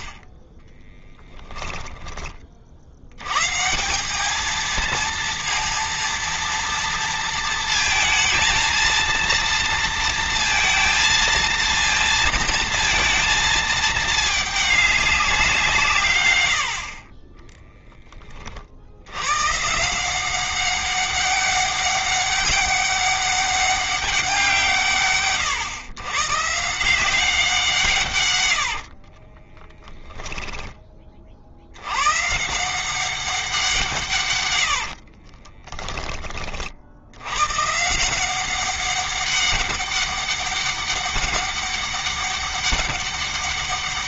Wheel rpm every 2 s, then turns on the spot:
20, 80, 230, 230, 230, 230, 230, 200, 40, 80, 190, 200, 160, 160, 40, 30, 180, 70, 70, 200, 200, 200.
0-2 28-30 34-36